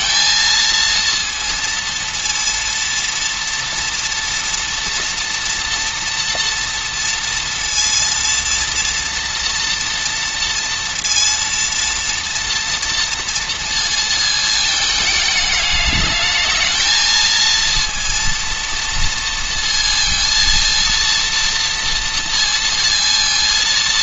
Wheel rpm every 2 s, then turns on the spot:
230, 230, 230, 230, 230, 230, 230, 220, 220, 230, 230, 230.
none